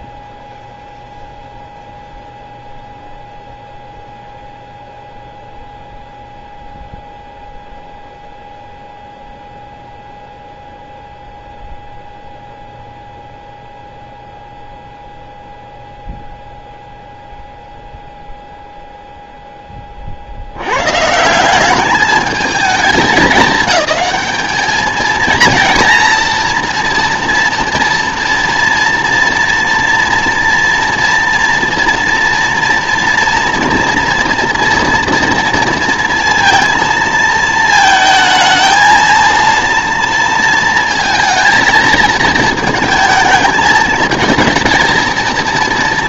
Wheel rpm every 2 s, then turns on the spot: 0, 0, 0, 0, 0, 0, 0, 0, 0, 0, 110, 210, 220, 230, 230, 240, 230, 230, 230, 230, 230, 220, 220.
none